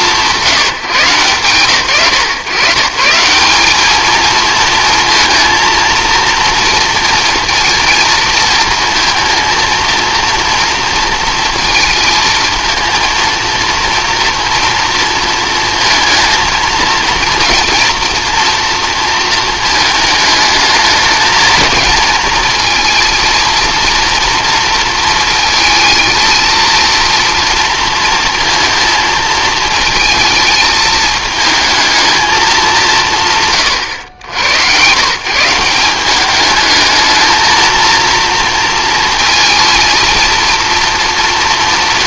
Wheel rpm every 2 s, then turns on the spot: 160, 140, 230, 230, 230, 230, 220, 230, 230, 240, 220, 230, 230, 230, 230, 220, 200, 110, 210, 230, 230.
none